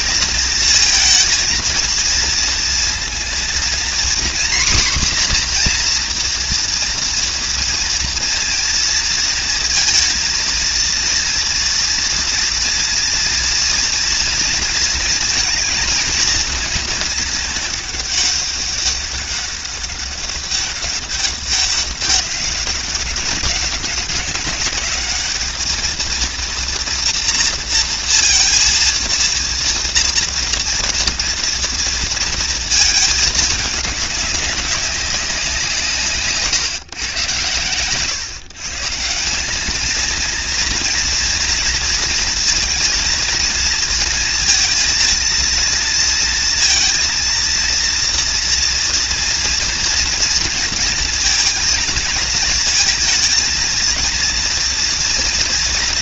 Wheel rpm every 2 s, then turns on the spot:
220, 230, 260, 230, 230, 230, 230, 230, 220, 200, 200, 200, 200, 230, 230, 230, 220, 200, 130, 160, 230, 230, 230, 230, 240, 230, 220, 230.
none